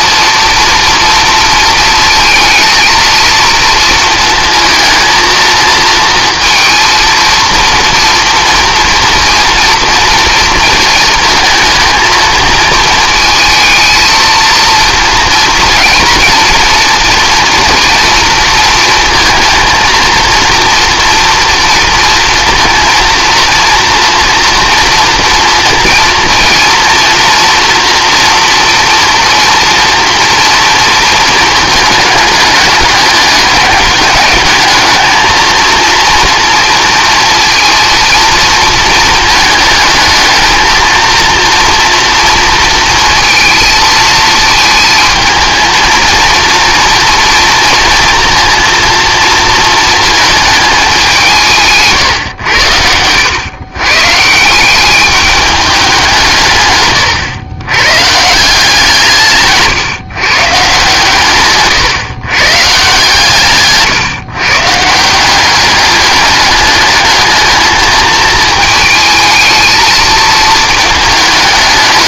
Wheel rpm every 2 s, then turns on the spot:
230, 230, 230, 230, 230, 230, 230, 230, 230, 230, 230, 230, 240, 230, 230, 230, 200, 210, 230, 220, 230, 230, 220, 230, 230, 210, 100, 180, 130, 170, 150, 140, 150, 210, 220, 220.
52-54